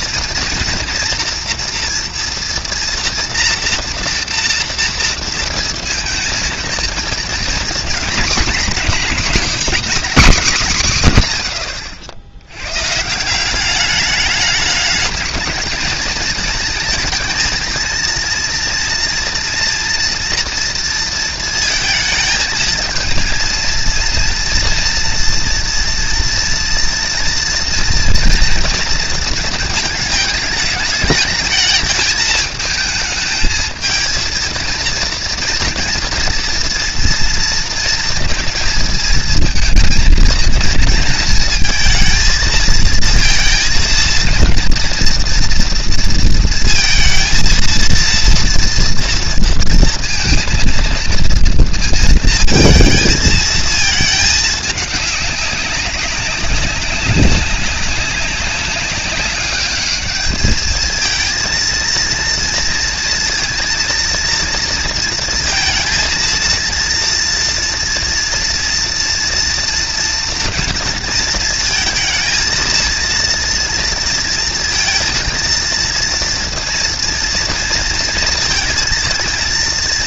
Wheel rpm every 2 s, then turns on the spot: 230, 230, 230, 230, 240, 150, 140, 210, 220, 230, 230, 230, 240, 230, 230, 220, 220, 230, 230, 220, 230, 230, 240, 230, 230, 230, 220, 200, 190, 200, 220, 230, 230, 230, 230, 230, 230, 230, 230, 230.
none